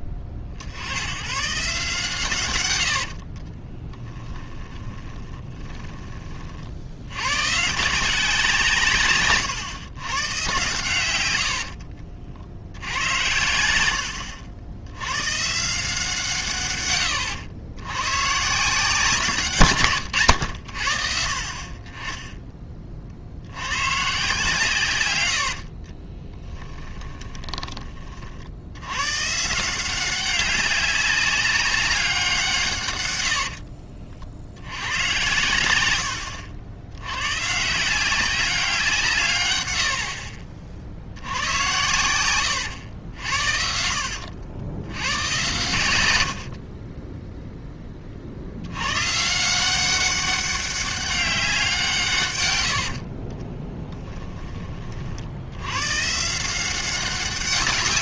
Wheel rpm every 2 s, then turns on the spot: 40, 110, 10, 60, 160, 110, 70, 80, 140, 150, 90, 20, 140, 10, 80, 200, 140, 80, 70, 180, 40, 100, 90, 50, 90, 200, 120, 20, 180.
4-6 26-28 42-44 46-48 52-54